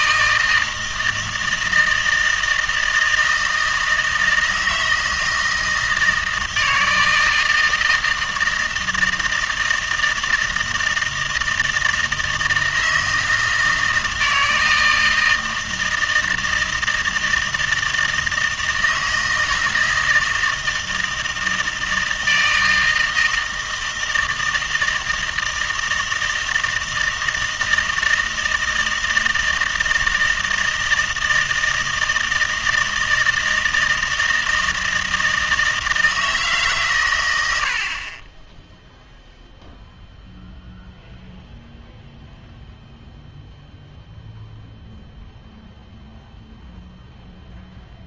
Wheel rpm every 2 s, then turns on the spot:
160, 160, 160, 160, 160, 160, 160, 160, 160, 160, 160, 160, 160, 160, 160, 160, 160, 160, 140, 10, 0, 0, 0, 0.
38-40